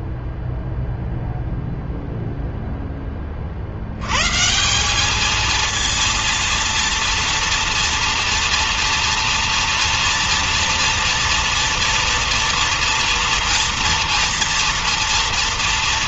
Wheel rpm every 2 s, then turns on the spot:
0, 20, 200, 230, 230, 230, 230, 230.
none